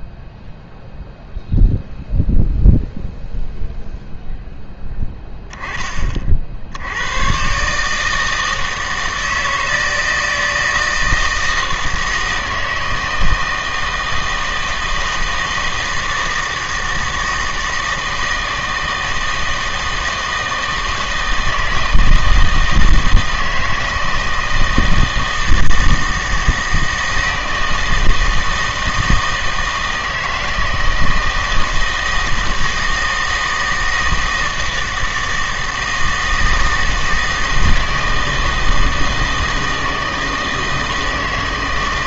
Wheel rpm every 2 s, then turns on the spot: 0, 0, 10, 70, 160, 160, 160, 160, 160, 160, 160, 160, 160, 160, 160, 160, 160, 160, 160, 160, 160.
none